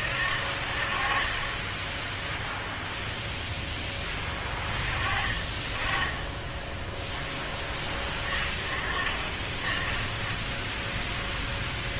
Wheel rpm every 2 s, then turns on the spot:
40, 0, 10, 10, 30, 0.
none